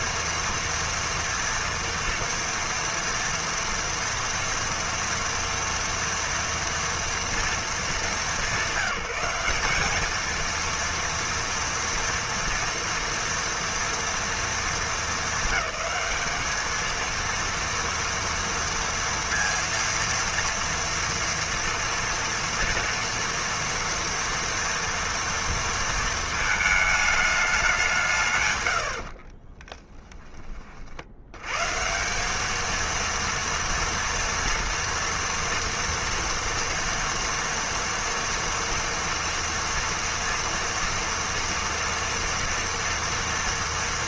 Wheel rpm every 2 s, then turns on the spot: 230, 230, 230, 230, 190, 230, 230, 230, 220, 230, 230, 230, 230, 220, 120, 30, 220, 230, 230, 230, 230, 230.
28-30